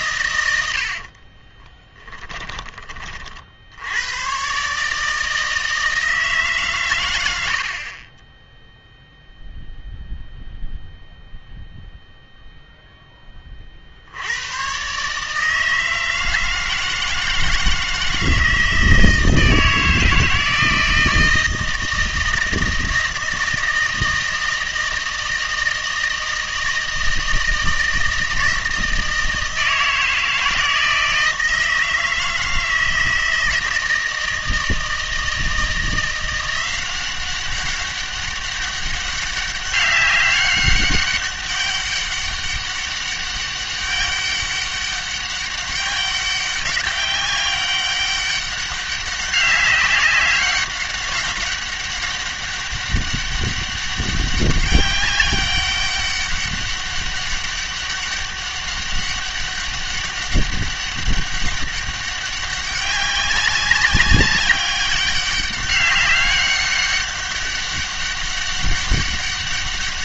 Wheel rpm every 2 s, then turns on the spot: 80, 20, 140, 120, 0, 0, 0, 120, 160, 160, 160, 160, 160, 160, 160, 160, 160, 160, 180, 200, 200, 200, 200, 190, 200, 200, 200, 200, 200, 200, 200, 200, 200, 200, 200.
0-2